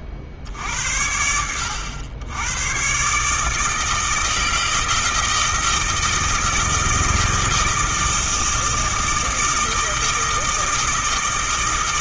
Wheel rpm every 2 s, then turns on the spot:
50, 130, 160, 160, 160, 160.
none